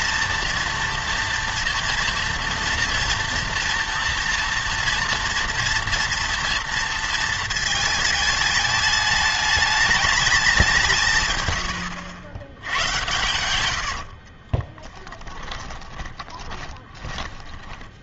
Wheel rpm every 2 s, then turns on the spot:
230, 230, 230, 230, 210, 190, 90, 20, 20.
14-18